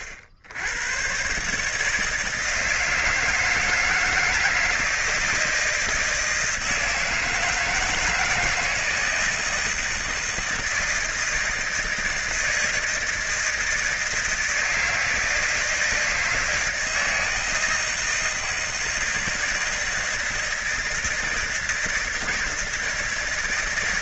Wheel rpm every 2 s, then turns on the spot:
80, 160, 160, 170, 160, 160, 160, 160, 160, 160, 160, 160.
none